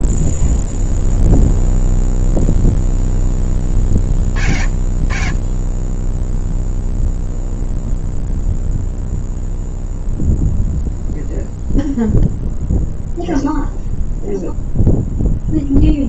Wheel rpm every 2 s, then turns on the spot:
0, 0, 50, 0, 0, 0, 0, 0.
none